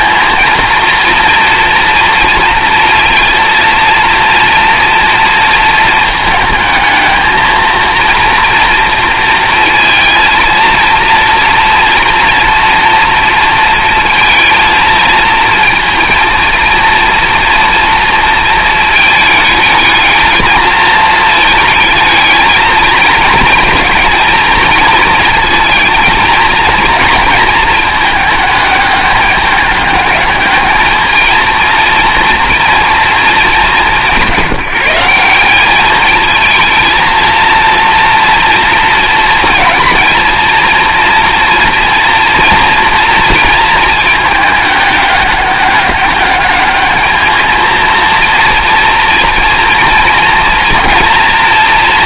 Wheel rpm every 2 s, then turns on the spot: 230, 230, 220, 230, 230, 230, 230, 230, 230, 220, 220, 220, 230, 210, 210, 230, 190, 220, 230, 230, 230, 220, 200, 230, 240, 230.
none